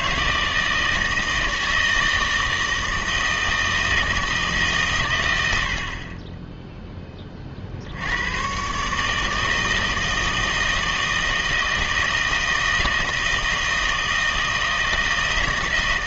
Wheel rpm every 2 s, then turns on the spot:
160, 160, 150, 10, 120, 160, 160, 160.
none